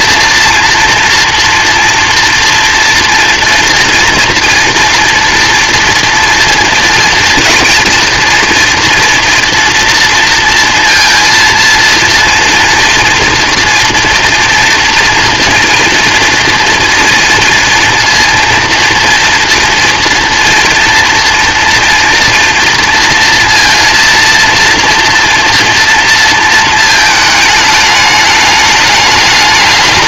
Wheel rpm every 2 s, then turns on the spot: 230, 240, 230, 230, 230, 230, 240, 230, 230, 230, 230, 230, 230, 230, 210.
none